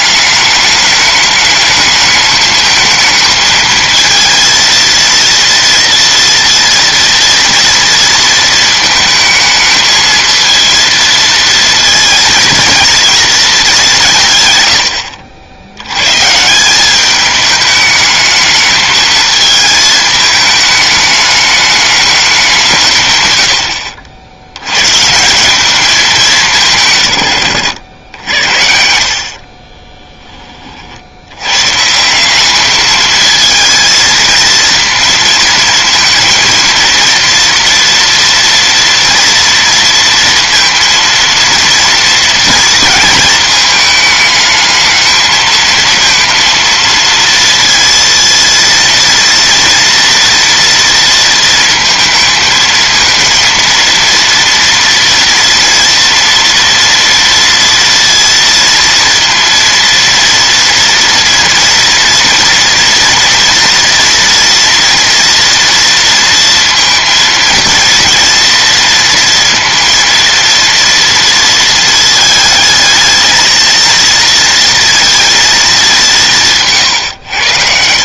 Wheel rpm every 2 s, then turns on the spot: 210, 220, 230, 230, 220, 230, 220, 110, 170, 220, 210, 160, 100, 160, 60, 40, 210, 230, 230, 230, 230, 230, 220, 230, 230, 230, 230, 230, 230, 230, 230, 230, 230, 230, 230, 230, 220, 230, 140.
none